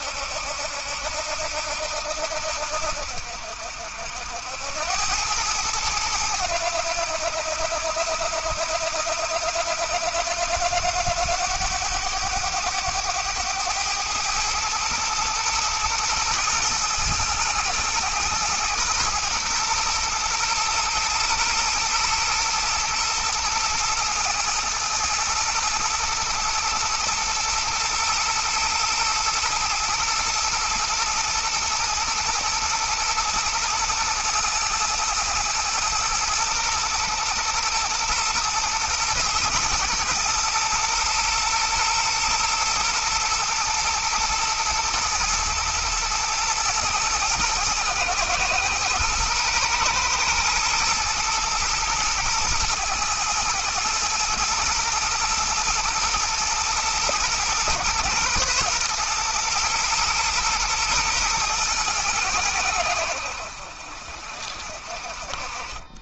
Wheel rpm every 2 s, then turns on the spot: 80, 70, 90, 90, 80, 90, 100, 110, 110, 120, 110, 110, 120, 110, 110, 110, 120, 110, 120, 110, 110, 120, 120, 110, 120, 110, 110, 110, 110, 120, 110, 80, 40.
none